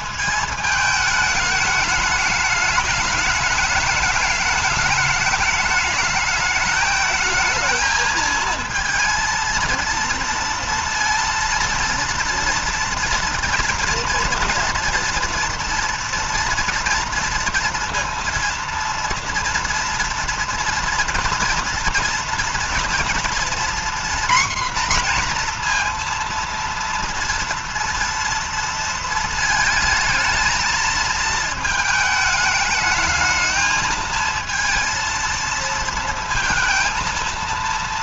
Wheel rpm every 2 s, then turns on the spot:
220, 210, 220, 220, 230, 230, 230, 230, 230, 230, 230, 230, 250, 230, 230, 220, 220, 220, 230.
none